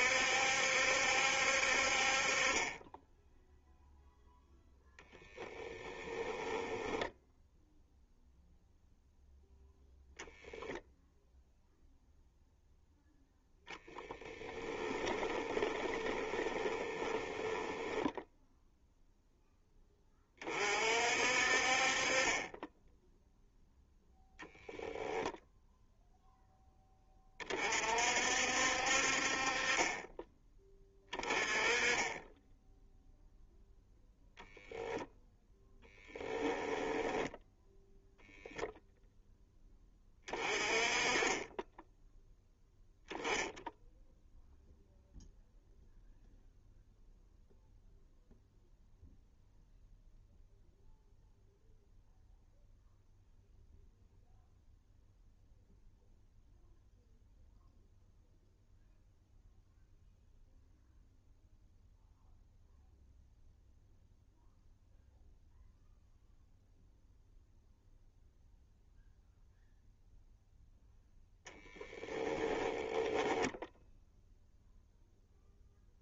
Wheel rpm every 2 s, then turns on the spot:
70, 20, 0, 10, 0, 0, 0, 20, 20, 0, 50, 10, 0, 20, 50, 20, 0, 0, 10, 0, 20, 0, 0, 0, 0, 0, 0, 0, 0, 0, 0, 0, 0, 0, 0, 0, 10, 0.
6-8 14-18 36-38 72-74